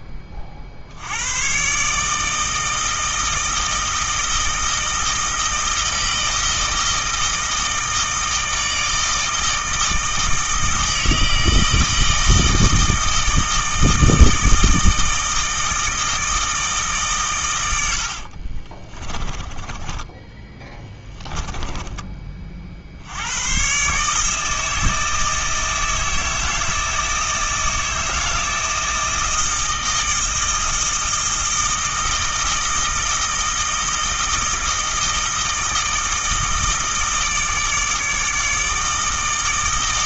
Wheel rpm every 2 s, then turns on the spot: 60, 160, 160, 160, 160, 160, 160, 160, 150, 30, 10, 50, 160, 160, 160, 160, 160, 160, 160, 160.
18-22